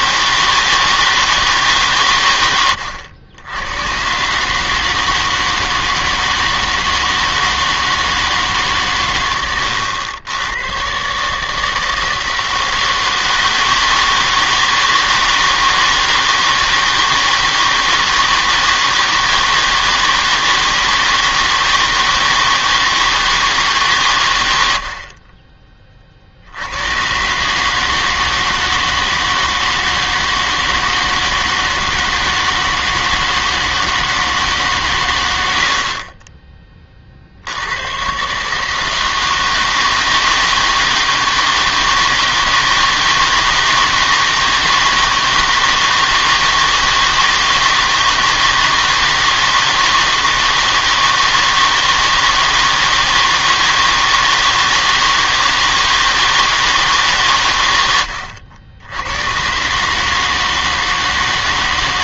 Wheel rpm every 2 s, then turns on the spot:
160, 100, 150, 160, 150, 110, 160, 160, 160, 160, 160, 160, 80, 80, 160, 160, 160, 140, 20, 150, 160, 160, 160, 160, 160, 160, 160, 160, 160, 80, 160.
none